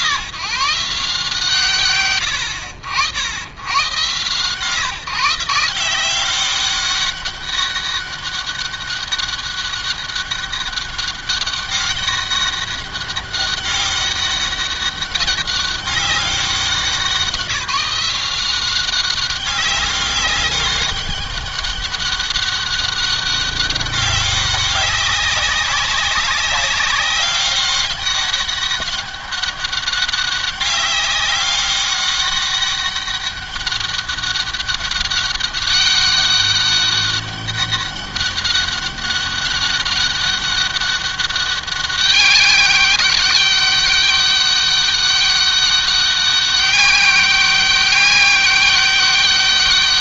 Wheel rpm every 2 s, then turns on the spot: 150, 80, 140, 190, 200, 200, 200, 200, 190, 190, 200, 200, 200, 190, 200, 200, 200, 200, 200, 200, 200, 200, 200, 190, 190.
none